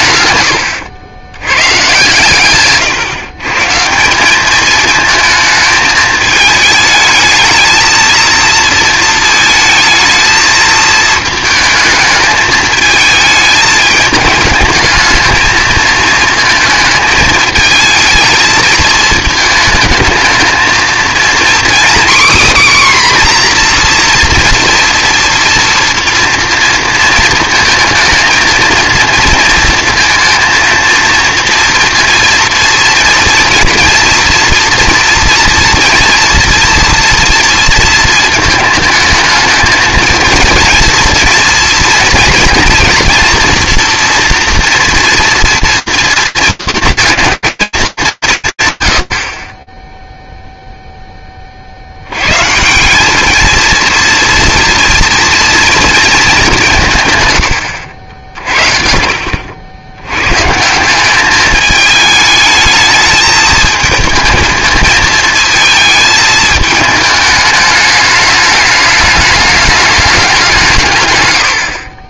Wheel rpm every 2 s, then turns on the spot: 110, 130, 210, 210, 230, 220, 220, 220, 220, 220, 230, 260, 230, 230, 220, 230, 230, 230, 230, 220, 230, 230, 240, 230, 150, 0, 170, 230, 180, 50, 170, 220, 220, 210, 210, 150.
none